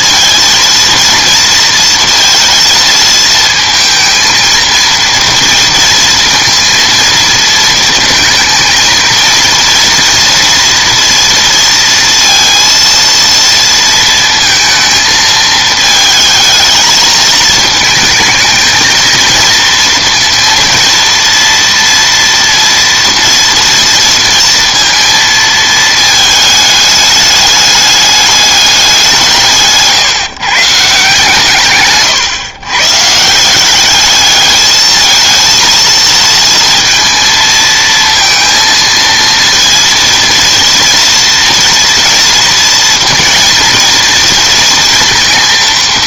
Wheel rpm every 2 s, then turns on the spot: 230, 230, 230, 230, 230, 240, 230, 230, 220, 220, 230, 230, 230, 210, 200, 150, 120, 210, 230, 230, 230, 230, 230.
none